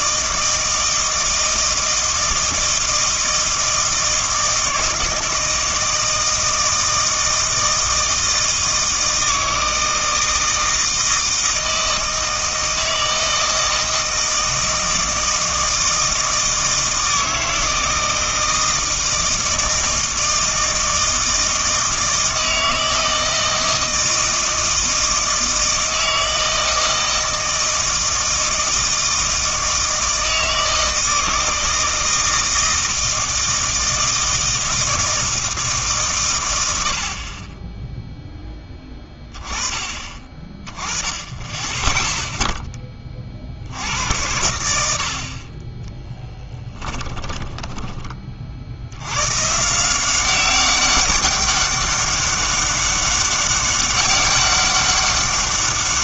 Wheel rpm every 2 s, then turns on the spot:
160, 160, 160, 160, 160, 160, 160, 160, 160, 160, 160, 160, 160, 160, 160, 160, 160, 160, 80, 10, 20, 10, 80, 20, 60, 190, 200, 200.
46-48